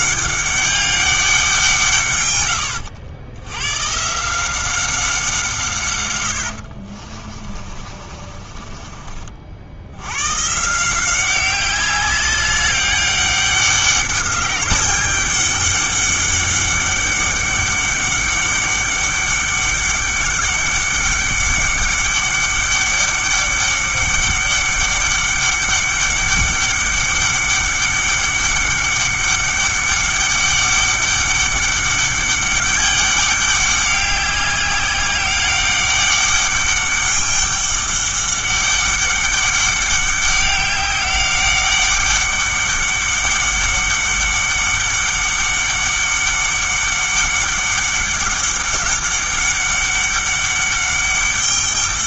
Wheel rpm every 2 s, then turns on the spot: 200, 100, 180, 70, 30, 150, 200, 200, 200, 200, 200, 200, 200, 200, 200, 200, 200, 190, 200, 200, 200, 200, 200, 200, 200, 200.
2-4 6-10